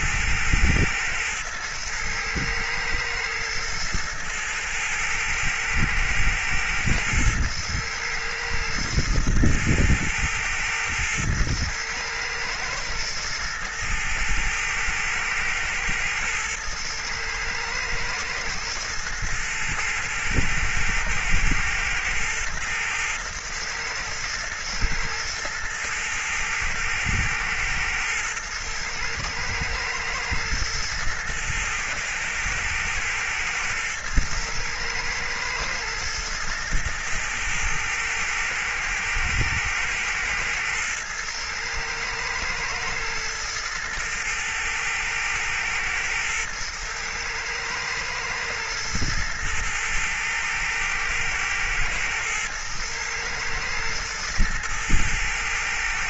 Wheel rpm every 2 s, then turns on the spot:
110, 110, 110, 110, 110, 110, 120, 110, 110, 110, 110, 110, 110, 110, 110, 110, 110, 110, 110, 110, 110, 120, 110, 110, 110, 110, 110, 110.
none